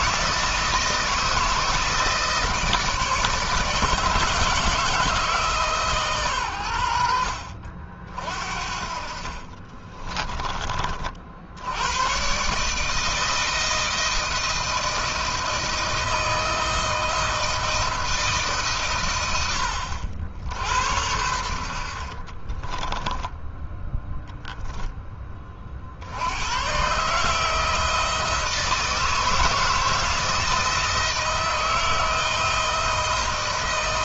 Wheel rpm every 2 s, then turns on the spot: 160, 160, 160, 90, 40, 30, 150, 160, 160, 140, 80, 10, 10, 120, 160, 160, 160.
8-10 22-24